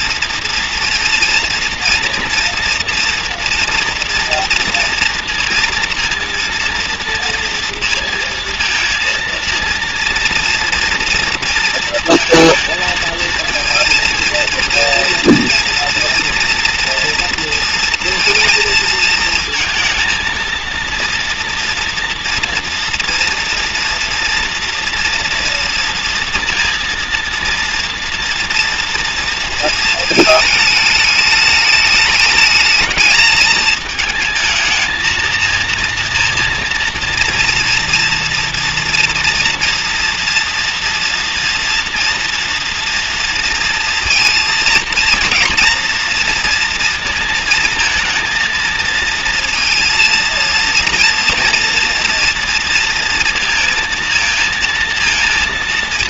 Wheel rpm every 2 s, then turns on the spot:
230, 230, 240, 230, 230, 230, 230, 230, 230, 230, 230, 240, 230, 230, 230, 210, 220, 220, 230, 230, 230, 230, 230, 230, 230, 230, 230, 230.
none